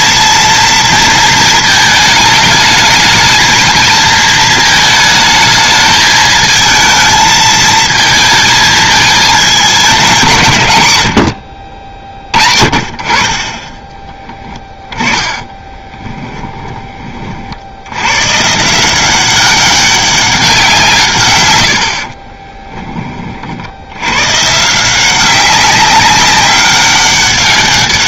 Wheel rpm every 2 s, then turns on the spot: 230, 220, 220, 220, 220, 110, 40, 20, 20, 170, 160, 20, 170, 200.
14-18